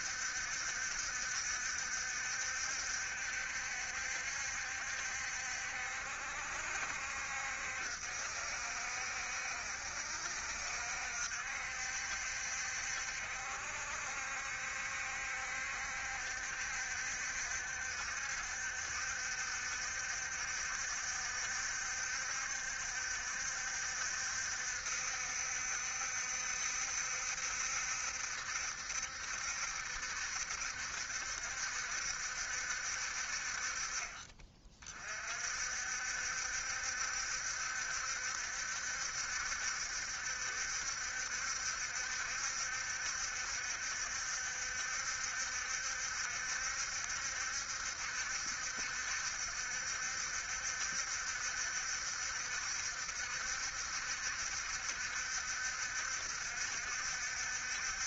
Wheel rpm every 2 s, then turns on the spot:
70, 70, 70, 60, 60, 60, 60, 60, 70, 70, 70, 70, 70, 70, 70, 70, 60, 40, 70, 70, 70, 70, 70, 70, 60, 60, 70, 70, 60.
none